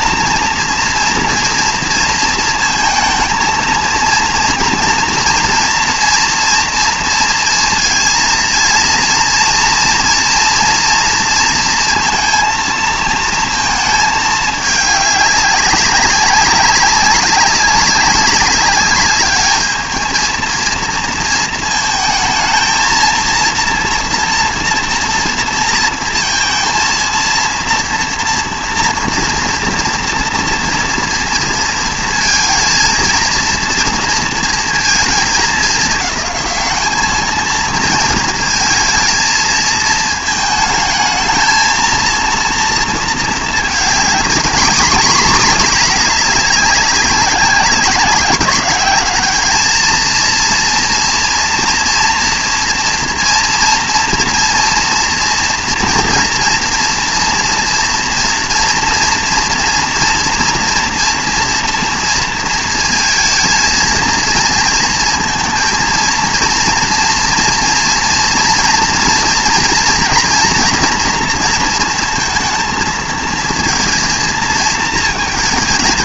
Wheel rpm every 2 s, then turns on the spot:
230, 220, 230, 230, 230, 230, 230, 210, 200, 200, 230, 230, 230, 230, 230, 230, 230, 230, 210, 220, 220, 230, 230, 200, 200, 230, 230, 230, 230, 230, 230, 230, 230, 230, 230, 230, 230, 220.
none